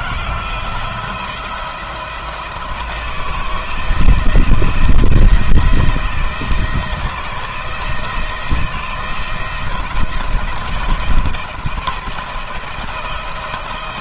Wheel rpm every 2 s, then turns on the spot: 170, 170, 160, 160, 170, 170, 160.
none